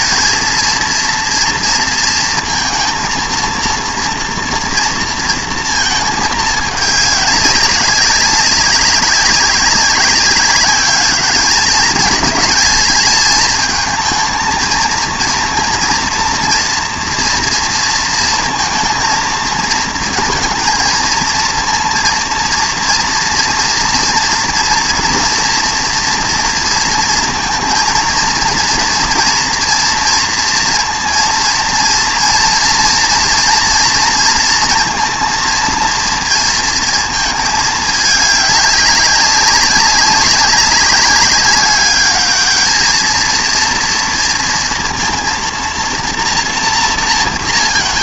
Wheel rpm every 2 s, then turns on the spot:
230, 230, 230, 210, 190, 200, 220, 230, 230, 230, 230, 230, 230, 230, 230, 230, 240, 230, 230, 200, 200, 220, 230, 240.
none